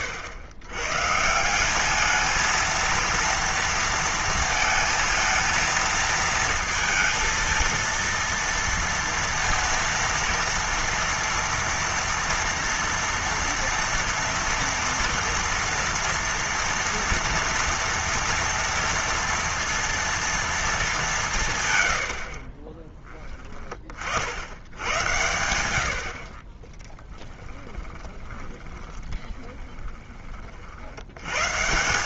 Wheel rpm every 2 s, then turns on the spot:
110, 230, 230, 230, 230, 230, 230, 230, 230, 230, 210, 30, 100, 30, 20, 50.
22-24 26-30